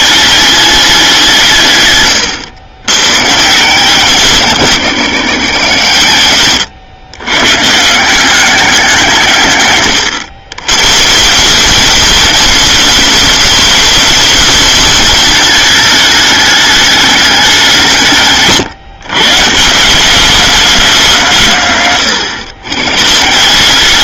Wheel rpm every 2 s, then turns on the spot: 180, 120, 170, 120, 160, 160, 210, 210, 200, 150, 180, 150.
none